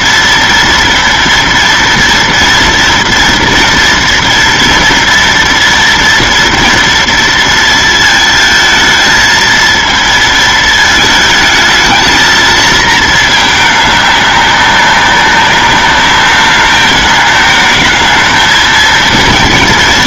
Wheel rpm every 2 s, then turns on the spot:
230, 230, 230, 230, 220, 220, 220, 200, 210, 220.
none